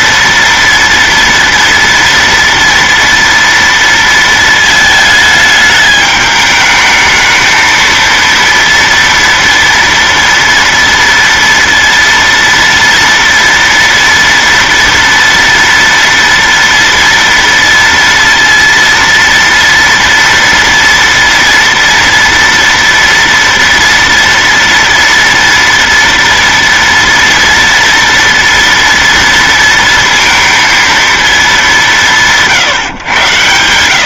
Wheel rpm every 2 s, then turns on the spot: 240, 230, 220, 210, 230, 230, 230, 230, 230, 230, 230, 240, 230, 230, 230, 230, 150.
none